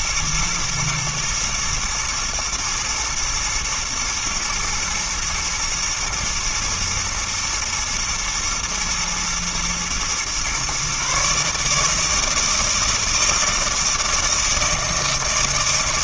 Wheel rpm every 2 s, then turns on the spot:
110, 110, 120, 110, 110, 130, 160, 160.
none